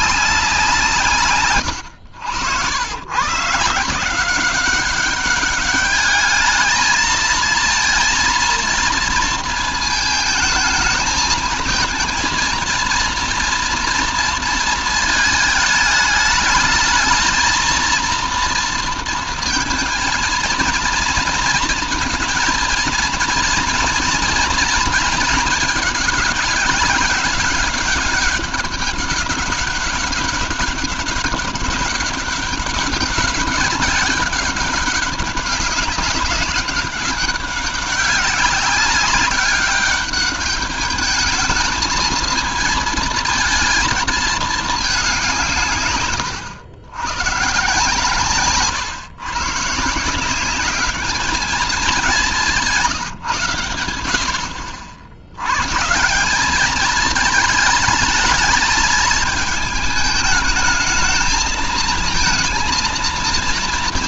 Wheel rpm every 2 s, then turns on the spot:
170, 100, 190, 220, 230, 220, 230, 230, 220, 230, 230, 230, 230, 200, 200, 200, 190, 190, 190, 200, 210, 220, 210, 100, 130, 200, 170, 60, 210, 220, 220, 220.
none